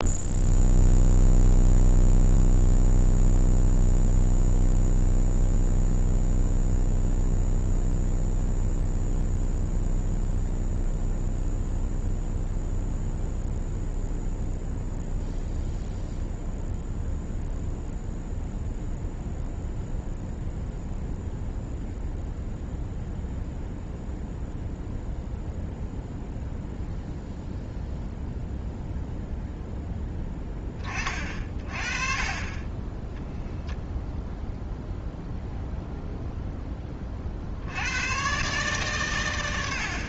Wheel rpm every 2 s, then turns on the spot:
0, 0, 0, 0, 0, 0, 0, 0, 0, 0, 0, 0, 0, 0, 0, 30, 20, 0, 30, 130.
none